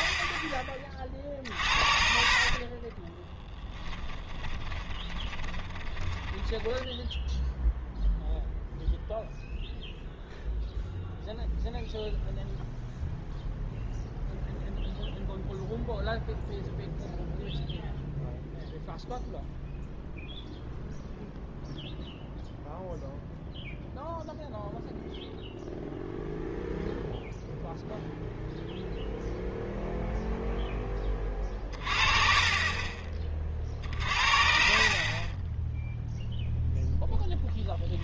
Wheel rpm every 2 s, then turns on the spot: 30, 30, 20, 10, 0, 0, 0, 0, 0, 0, 0, 0, 0, 0, 0, 10, 30, 50, 0.
2-8